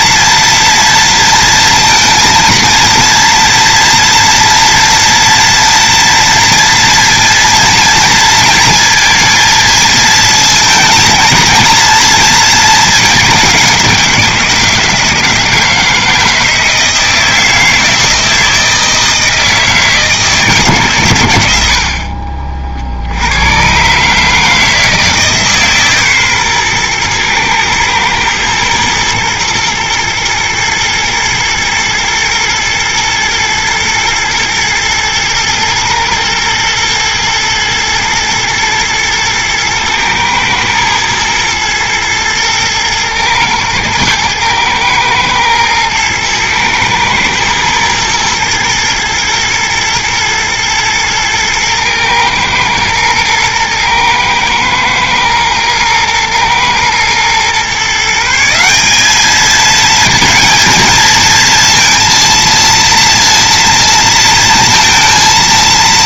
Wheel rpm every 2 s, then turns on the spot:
230, 230, 230, 230, 230, 220, 220, 170, 160, 160, 150, 50, 160, 120, 110, 120, 110, 110, 120, 110, 110, 110, 110, 110, 120, 110, 110, 110, 120, 180, 220, 230, 230.
none